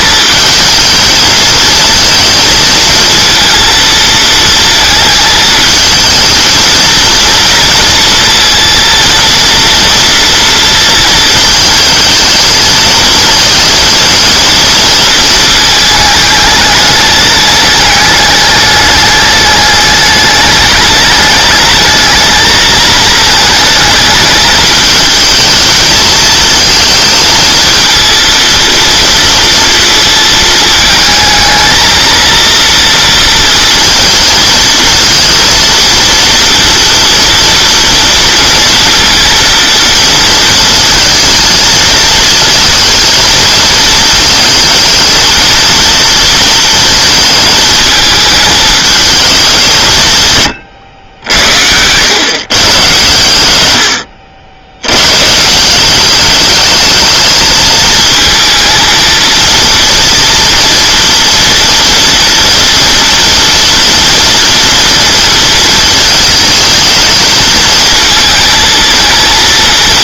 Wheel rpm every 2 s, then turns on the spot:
220, 230, 230, 230, 230, 230, 220, 230, 210, 210, 210, 220, 220, 220, 230, 220, 230, 230, 230, 230, 220, 230, 220, 220, 220, 100, 130, 90, 210, 220, 230, 230, 230, 220, 230.
none